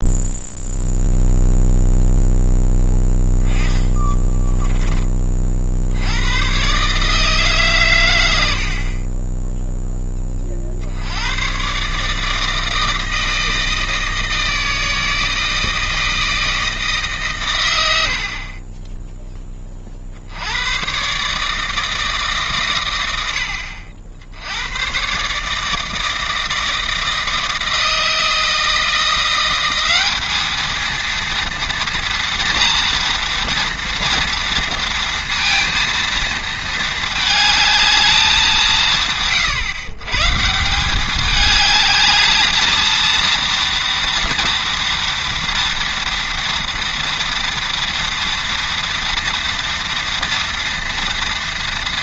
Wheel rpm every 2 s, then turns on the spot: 0, 10, 20, 140, 50, 70, 160, 160, 150, 20, 120, 120, 110, 160, 170, 230, 230, 230, 220, 170, 190, 220, 230, 230, 230, 230.
none